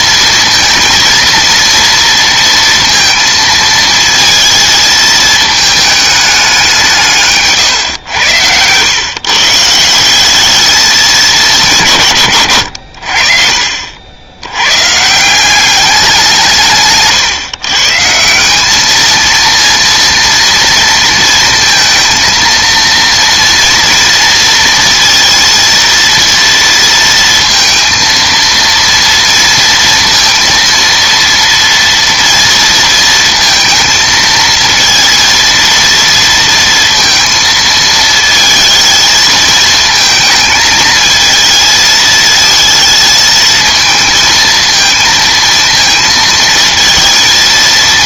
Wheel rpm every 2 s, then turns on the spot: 220, 230, 220, 170, 120, 210, 90, 120, 150, 210, 230, 230, 230, 230, 230, 230, 230, 230, 230, 230, 220, 220, 230, 230.
12-14